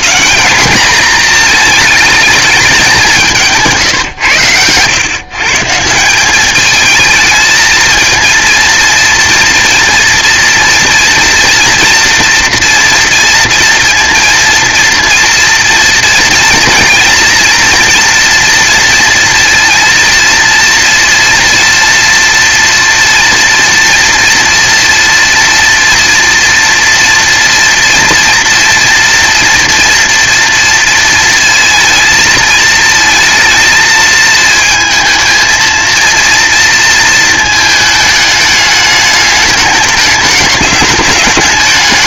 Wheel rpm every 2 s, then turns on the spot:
220, 200, 110, 210, 230, 230, 240, 230, 240, 230, 230, 230, 230, 230, 240, 230, 220, 220, 230, 210, 210.
none